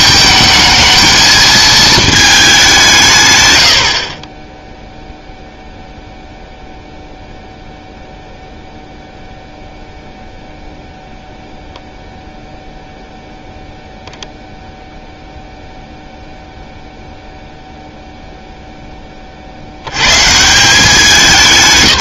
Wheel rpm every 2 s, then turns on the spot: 220, 190, 0, 0, 0, 0, 0, 0, 0, 10, 180.
none